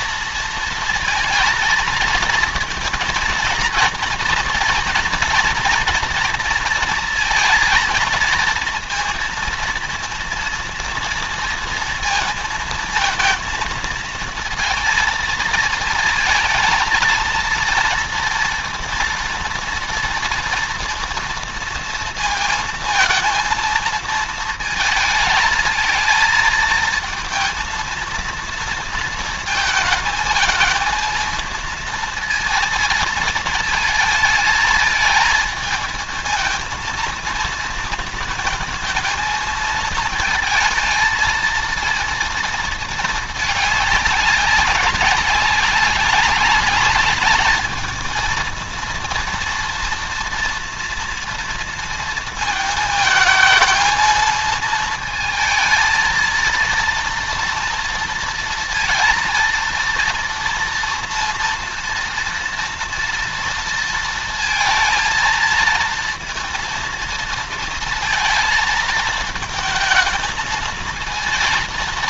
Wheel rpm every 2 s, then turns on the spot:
230, 230, 240, 230, 230, 230, 230, 220, 220, 230, 230, 230, 220, 230, 230, 220, 230, 220, 220, 220, 230, 220, 200, 210, 230, 230, 220, 230, 230, 230, 230, 230, 220, 230, 220, 220.
none